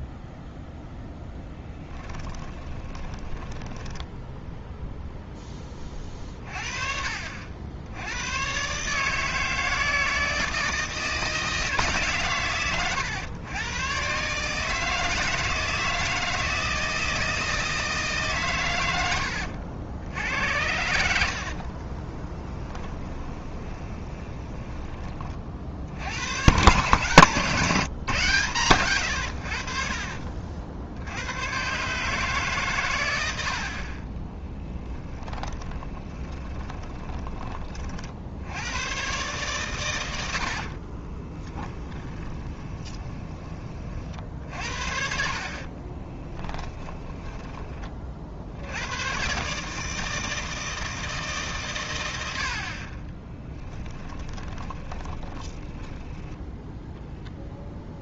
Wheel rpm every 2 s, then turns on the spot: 0, 20, 0, 50, 140, 160, 100, 160, 160, 100, 80, 20, 20, 130, 130, 70, 110, 10, 20, 110, 40, 20, 50, 10, 100, 160, 40, 20, 0.
2-4 20-24 34-38 40-44 46-48 52-56